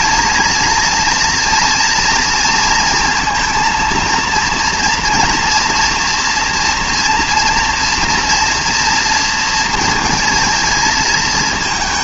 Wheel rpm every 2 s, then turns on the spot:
230, 230, 230, 240, 230, 220.
none